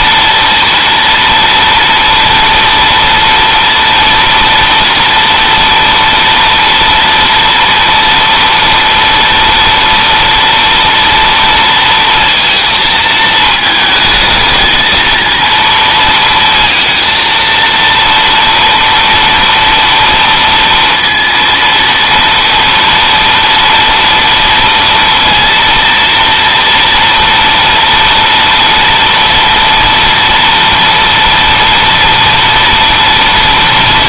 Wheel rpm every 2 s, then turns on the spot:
240, 230, 230, 240, 230, 230, 230, 220, 230, 230, 230, 230, 230, 230, 230, 230, 230.
none